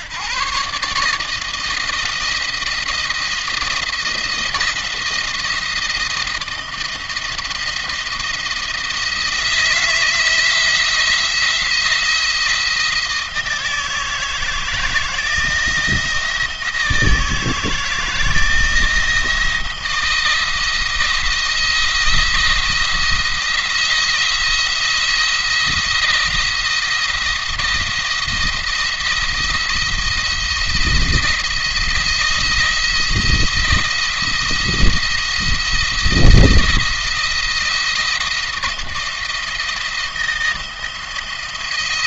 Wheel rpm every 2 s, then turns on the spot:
150, 170, 170, 160, 160, 170, 170, 160, 160, 170, 170, 170, 170, 170, 170, 170, 170, 170, 170, 170, 170.
none